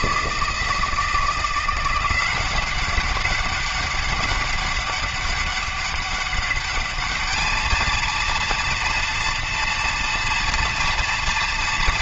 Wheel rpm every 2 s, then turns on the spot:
160, 190, 200, 210, 230, 230.
none